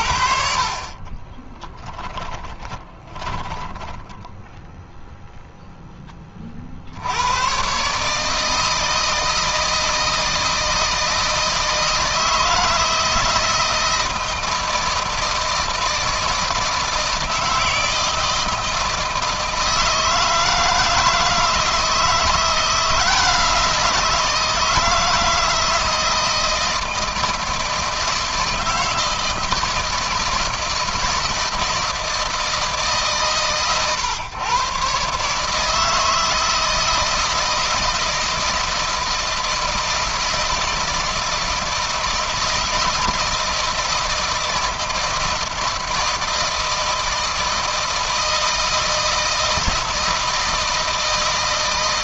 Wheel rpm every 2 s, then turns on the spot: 50, 10, 0, 50, 160, 160, 160, 160, 160, 160, 160, 170, 160, 160, 160, 170, 160, 130, 160, 160, 160, 160, 160, 160, 160, 160.
0-4